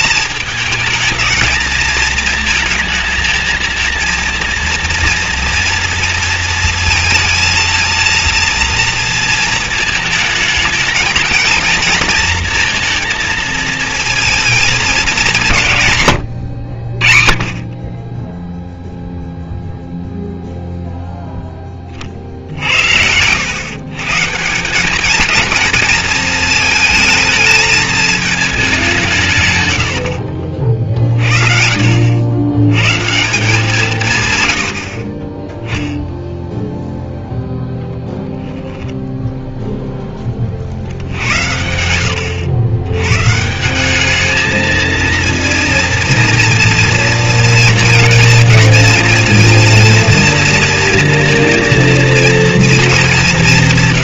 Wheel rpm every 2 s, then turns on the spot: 220, 220, 230, 230, 230, 220, 230, 180, 40, 0, 0, 90, 210, 220, 150, 40, 150, 20, 0, 0, 60, 120, 230, 230, 220, 230, 210.
40-42